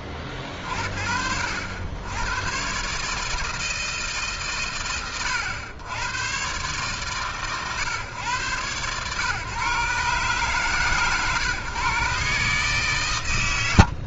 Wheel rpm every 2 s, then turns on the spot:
40, 130, 120, 120, 120, 140, 140.
none